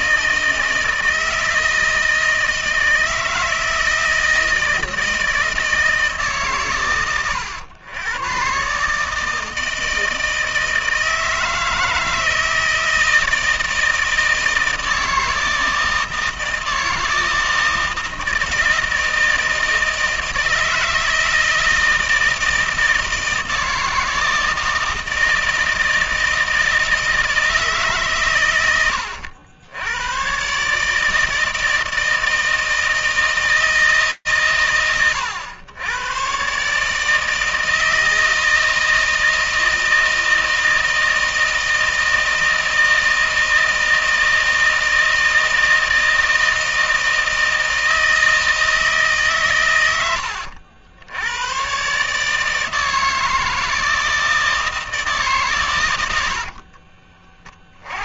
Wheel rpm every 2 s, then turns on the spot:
160, 160, 160, 160, 110, 160, 160, 160, 160, 160, 160, 160, 160, 160, 130, 110, 160, 120, 130, 160, 160, 160, 160, 160, 160, 80, 160, 160, 70.
56-58